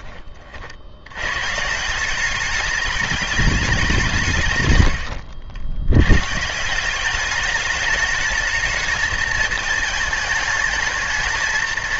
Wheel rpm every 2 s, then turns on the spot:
80, 210, 100, 190, 230, 220.
4-6